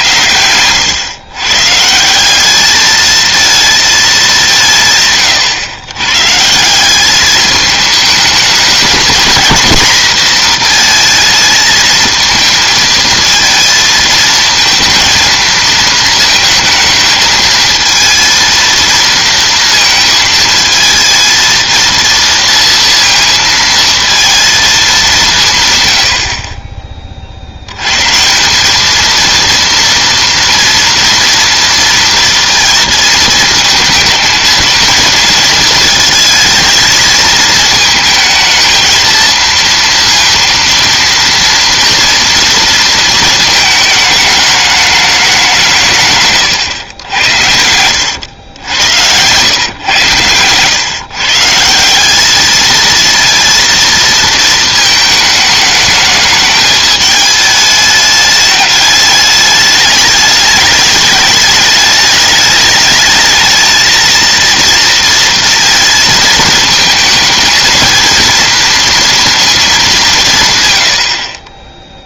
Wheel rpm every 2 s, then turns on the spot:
110, 210, 150, 170, 220, 230, 220, 230, 220, 230, 220, 230, 220, 20, 200, 230, 230, 220, 230, 220, 230, 230, 210, 100, 90, 120, 220, 220, 210, 210, 210, 210, 230, 220, 230, 130.
46-50